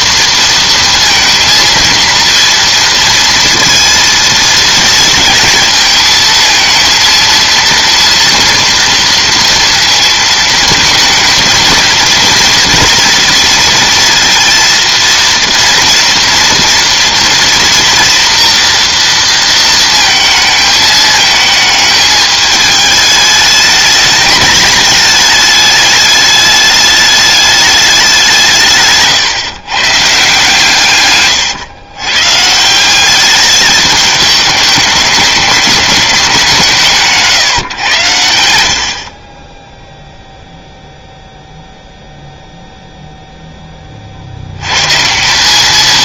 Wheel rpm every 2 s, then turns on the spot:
230, 230, 220, 230, 230, 220, 230, 230, 230, 230, 220, 210, 220, 210, 150, 150, 160, 200, 190, 70, 0, 0, 100.
none